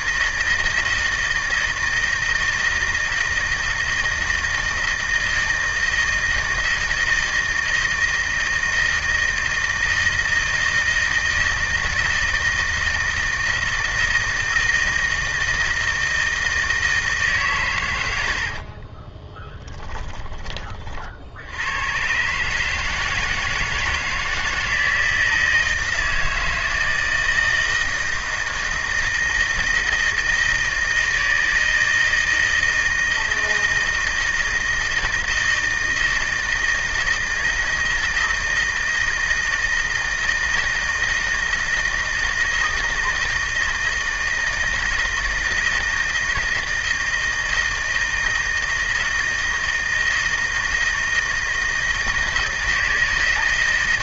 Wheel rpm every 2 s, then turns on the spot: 160, 160, 160, 160, 160, 160, 160, 160, 160, 40, 50, 160, 160, 160, 160, 160, 160, 160, 160, 160, 160, 160, 160, 160, 160, 160, 160.
18-20